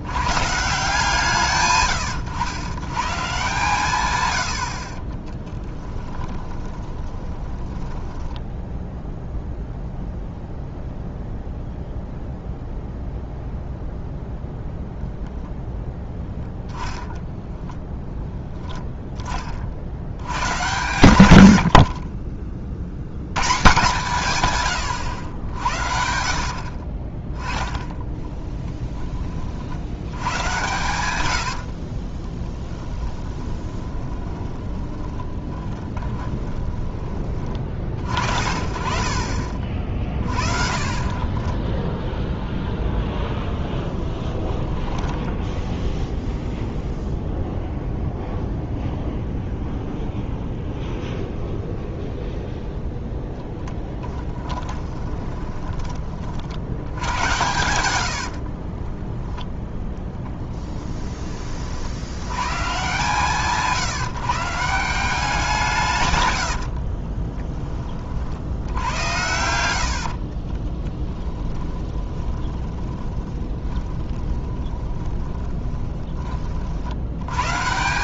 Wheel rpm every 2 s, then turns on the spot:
150, 110, 70, 20, 10, 0, 0, 0, 0, 0, 110, 50, 110, 70, 10, 110, 20, 20, 20, 40, 40, 10, 20, 0, 0, 0, 0, 20, 60, 60, 10, 120, 160, 80, 80, 30, 20, 20, 60.
6-10 28-30 32-38 44-46 54-56 58-60 66-68 70-76